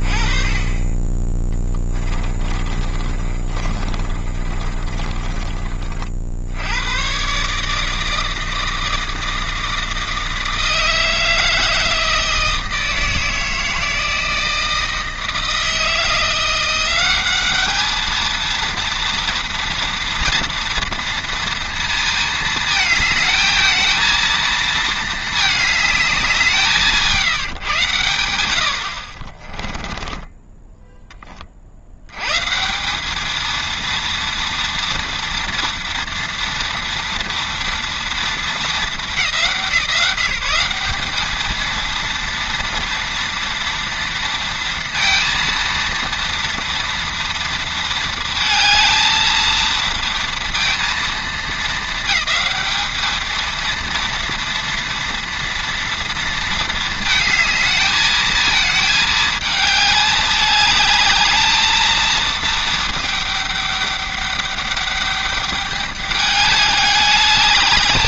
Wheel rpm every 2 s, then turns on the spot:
20, 30, 40, 60, 160, 160, 160, 160, 180, 230, 230, 220, 220, 170, 80, 10, 160, 230, 240, 190, 190, 230, 230, 230, 220, 230, 210, 230, 220, 220, 210, 220, 200, 210.
2-6 30-32